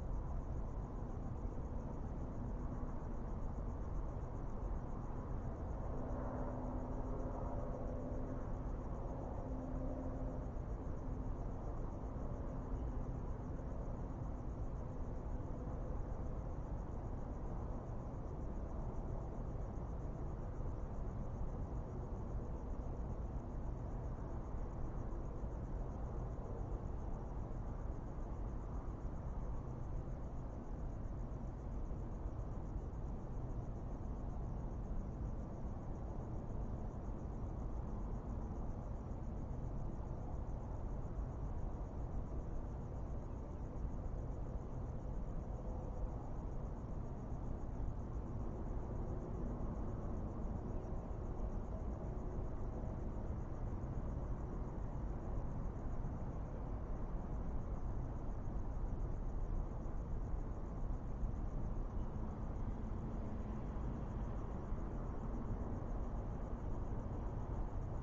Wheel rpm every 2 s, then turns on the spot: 0, 0, 0, 0, 0, 0, 0, 0, 0, 0, 0, 0, 0, 0, 0, 0, 0, 0, 0, 0, 0, 0, 0, 0, 0, 0, 0, 0, 0, 0, 0, 0, 0, 0.
none